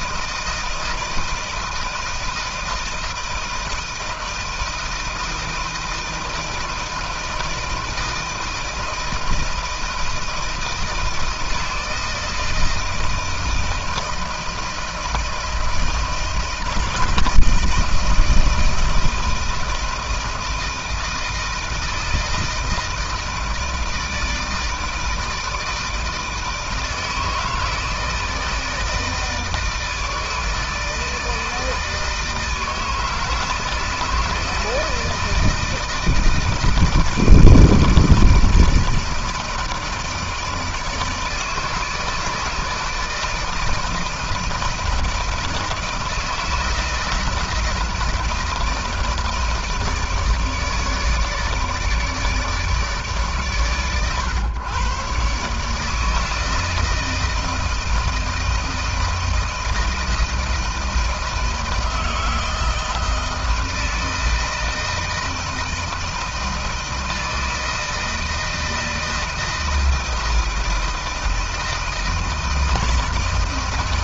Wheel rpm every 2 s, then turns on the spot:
160, 160, 160, 160, 160, 160, 160, 160, 160, 160, 160, 160, 160, 160, 160, 160, 160, 160, 160, 160, 160, 160, 160, 160, 160, 150, 150, 120, 160, 160, 160, 160, 160, 160, 160, 160, 160.
none